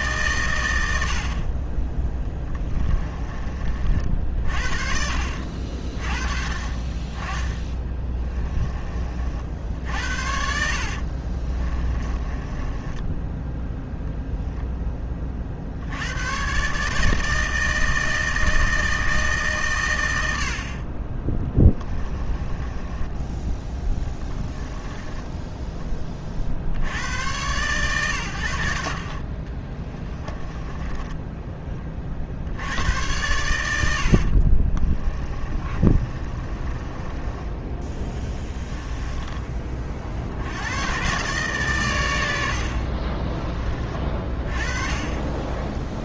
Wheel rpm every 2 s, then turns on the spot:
80, 30, 50, 30, 30, 70, 20, 10, 150, 160, 40, 20, 10, 60, 80, 10, 90, 30, 20, 20, 110, 50, 30.
2-4 10-14 22-26 30-32 34-40 42-44